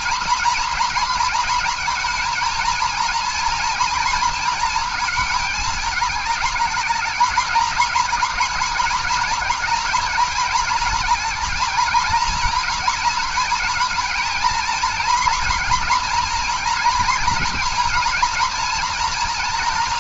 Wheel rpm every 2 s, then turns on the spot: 230, 230, 230, 220, 220, 220, 230, 230, 230, 230.
none